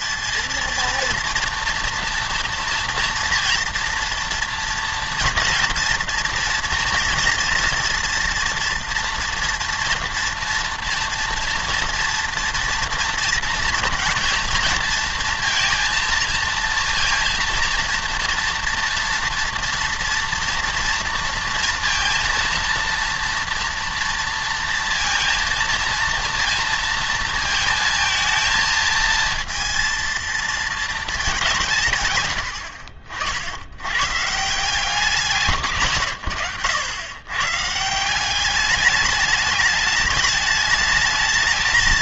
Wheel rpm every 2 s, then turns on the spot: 230, 230, 230, 230, 230, 230, 230, 230, 230, 230, 230, 230, 230, 230, 220, 230, 70, 160, 100, 200, 210.
none